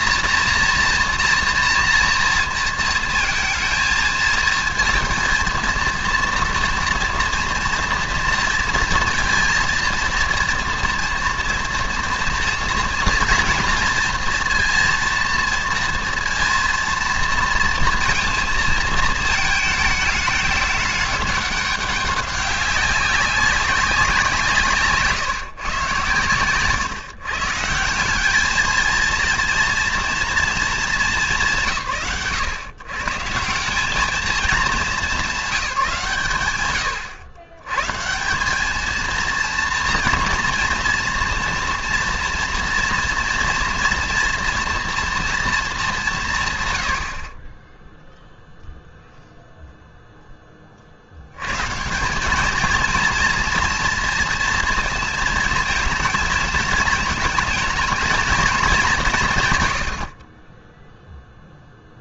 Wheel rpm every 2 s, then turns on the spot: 240, 230, 230, 240, 230, 230, 230, 230, 230, 230, 210, 200, 150, 120, 210, 240, 120, 210, 130, 200, 240, 230, 230, 130, 0, 30, 220, 230, 220, 220, 10.
none